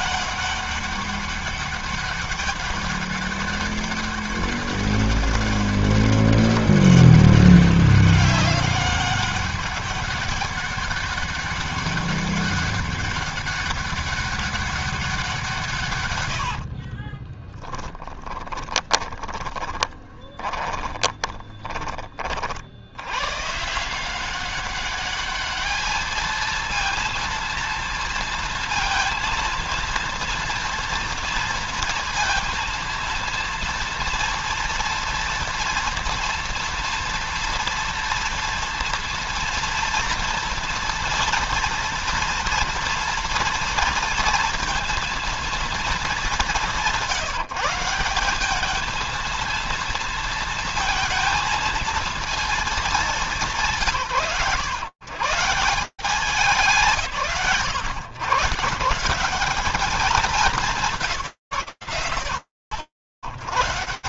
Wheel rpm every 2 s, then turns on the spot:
200, 200, 200, 200, 200, 200, 200, 190, 60, 20, 30, 30, 180, 220, 230, 230, 230, 230, 230, 230, 230, 230, 230, 190, 190, 230, 230, 140, 160, 150, 190, 110.
16-22